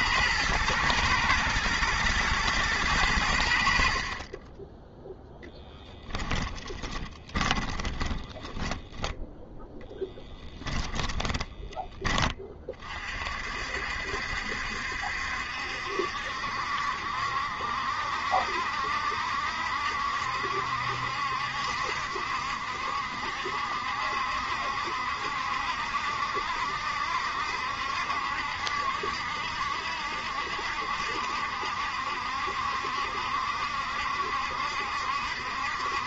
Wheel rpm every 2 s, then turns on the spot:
110, 100, 10, 10, 10, 20, 40, 70, 60, 60, 70, 60, 70, 70, 70, 70, 70, 70.
6-8 10-12